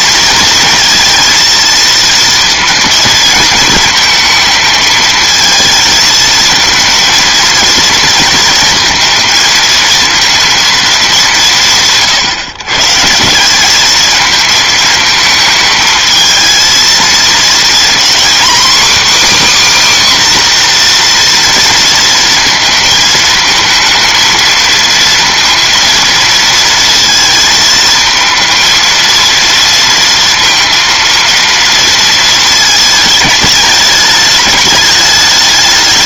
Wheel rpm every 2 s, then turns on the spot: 230, 230, 220, 220, 220, 220, 140, 220, 220, 270, 250, 220, 230, 230, 230, 230, 220, 210.
none